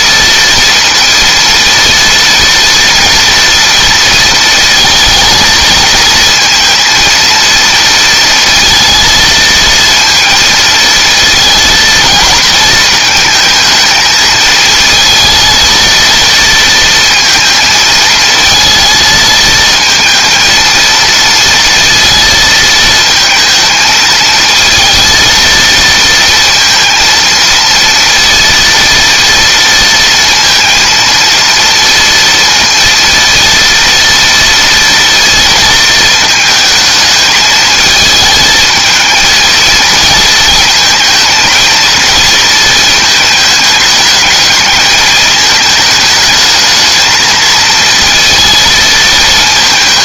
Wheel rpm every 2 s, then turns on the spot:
230, 230, 220, 220, 230, 230, 220, 220, 230, 220, 230, 220, 230, 230, 230, 230, 230, 230, 220, 220, 220, 220, 220, 220, 220.
none